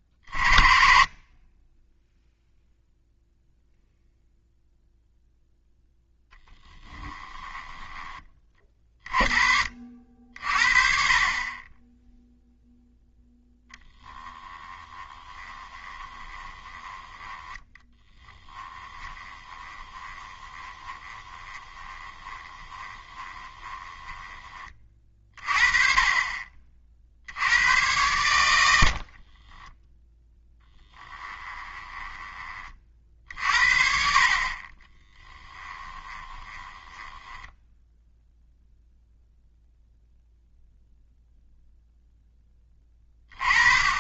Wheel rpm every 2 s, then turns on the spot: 40, 0, 0, 10, 20, 50, 0, 20, 20, 10, 20, 20, 20, 40, 90, 10, 30, 40, 20, 0, 0, 10.
6-8 14-24 30-32 36-38